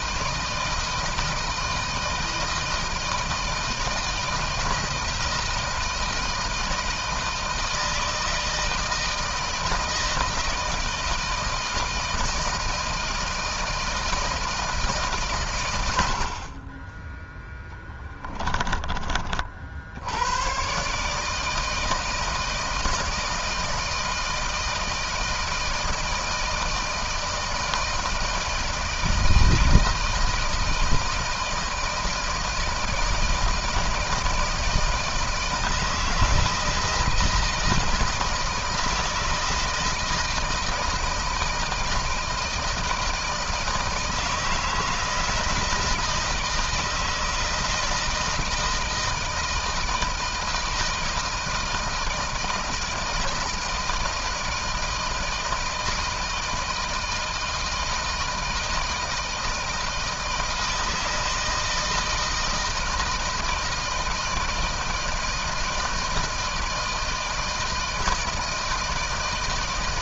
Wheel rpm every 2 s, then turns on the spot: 160, 160, 170, 160, 160, 160, 160, 160, 30, 20, 120, 160, 160, 160, 160, 160, 160, 160, 160, 160, 160, 160, 160, 160, 160, 160, 160, 160, 160, 160, 160, 160, 160, 160, 160.
none